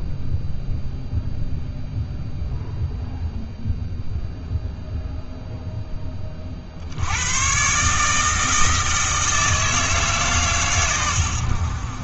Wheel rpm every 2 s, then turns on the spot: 0, 0, 0, 50, 160, 130.
none